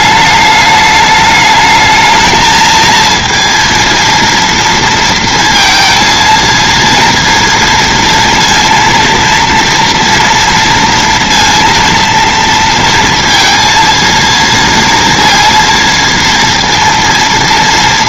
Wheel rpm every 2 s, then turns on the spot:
210, 230, 230, 230, 230, 230, 230, 230, 230.
none